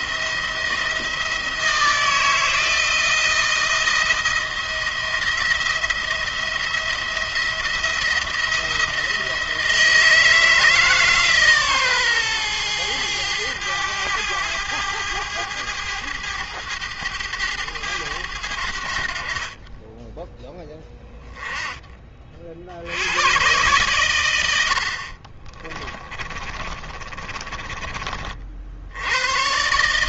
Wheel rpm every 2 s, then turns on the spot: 160, 160, 170, 170, 170, 160, 110, 100, 100, 70, 10, 80, 70, 30, 80.
24-28